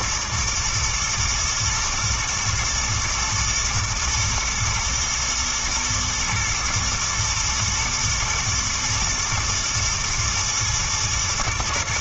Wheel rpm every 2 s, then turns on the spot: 120, 120, 120, 120, 110, 110.
none